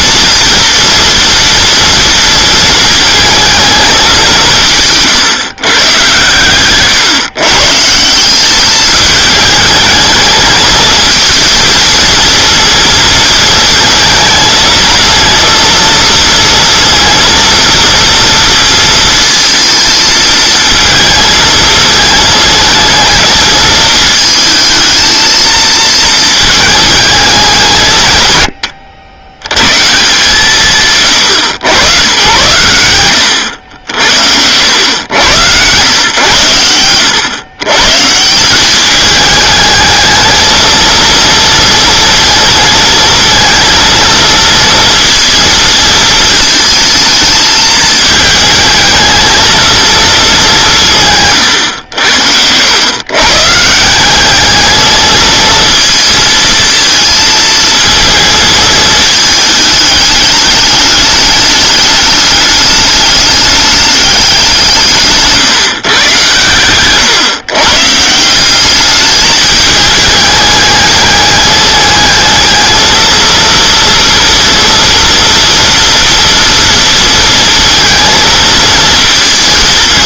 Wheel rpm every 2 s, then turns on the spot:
230, 230, 160, 130, 200, 220, 230, 230, 230, 230, 220, 220, 220, 220, 110, 190, 100, 90, 110, 190, 220, 230, 230, 220, 220, 190, 90, 210, 220, 220, 210, 210, 170, 130, 190, 210, 220, 240, 230, 230.
none